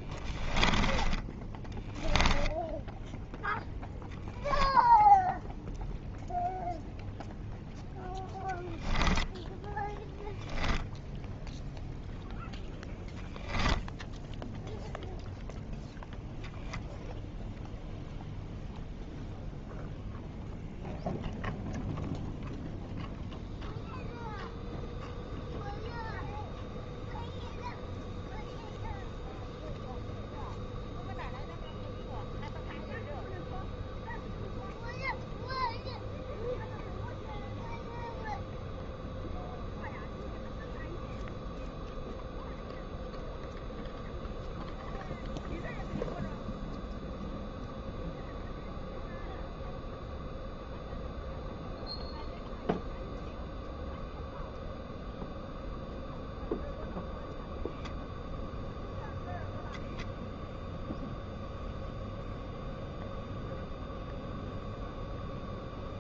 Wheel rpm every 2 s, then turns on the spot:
10, 10, 0, 0, 0, 10, 0, 0, 0, 0, 0, 0, 0, 0, 0, 0, 0, 0, 0, 0, 0, 0, 0, 0, 0, 0, 0, 0, 0, 0, 0, 0, 0.
0-2 10-12